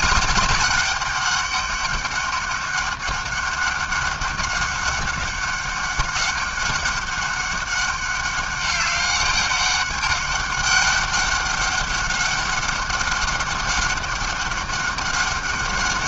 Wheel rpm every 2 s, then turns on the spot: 210, 200, 200, 200, 200, 200, 200, 200.
none